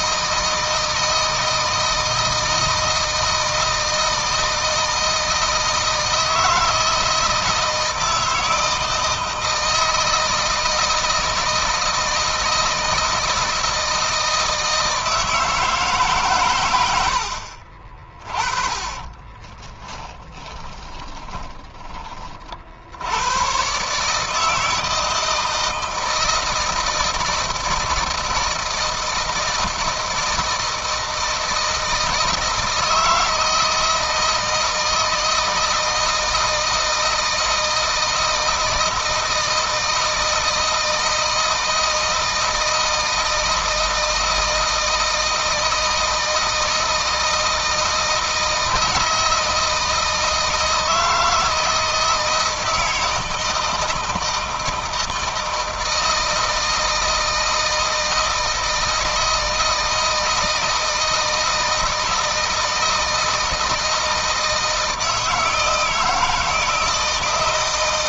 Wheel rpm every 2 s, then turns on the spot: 160, 160, 160, 160, 160, 160, 160, 160, 120, 30, 30, 70, 160, 160, 160, 160, 160, 160, 160, 160, 160, 160, 160, 160, 160, 160, 160, 160, 160, 160, 160, 160, 160, 160.
18-22